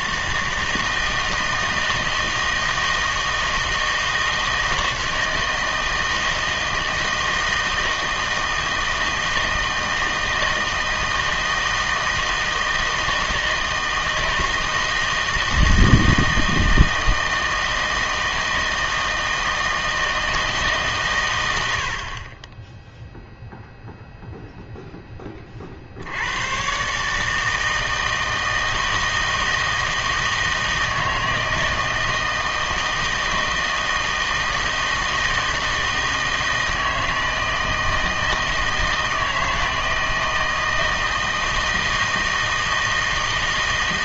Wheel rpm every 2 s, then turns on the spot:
160, 160, 160, 160, 160, 160, 160, 160, 160, 160, 150, 10, 0, 120, 160, 160, 160, 160, 160, 160, 160, 160.
none